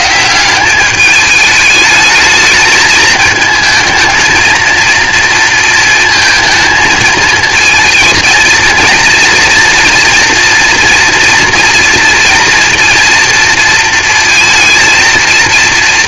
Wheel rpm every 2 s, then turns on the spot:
190, 220, 230, 220, 230, 230, 230, 230.
none